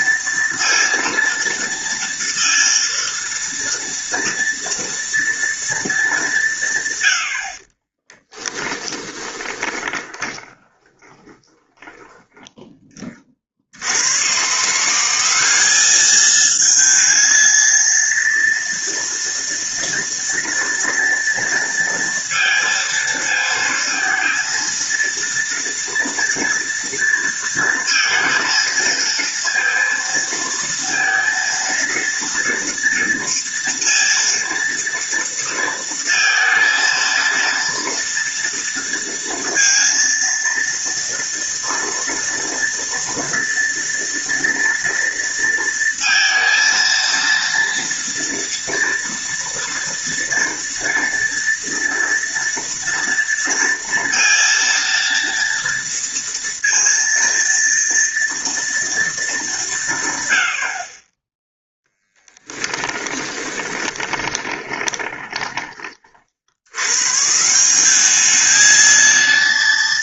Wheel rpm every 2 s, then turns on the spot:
230, 230, 230, 120, 20, 20, 10, 160, 220, 230, 240, 230, 230, 230, 230, 230, 230, 230, 230, 230, 230, 230, 230, 230, 230, 230, 230, 230, 230, 230, 40, 10, 20, 100, 220.
8-12 62-66